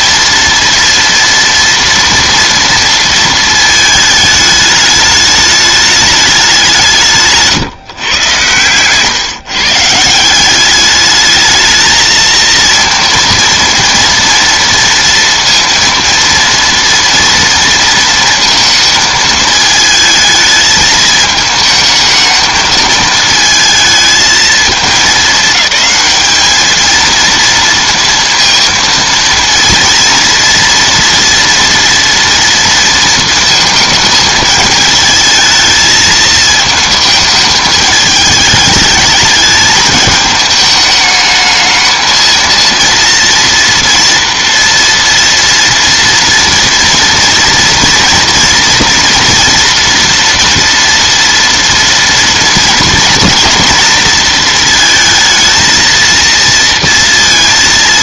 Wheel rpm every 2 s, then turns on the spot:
230, 230, 210, 190, 120, 190, 230, 230, 230, 220, 220, 220, 220, 220, 230, 230, 230, 220, 220, 210, 210, 230, 230, 230, 230, 230, 230, 230, 230.
none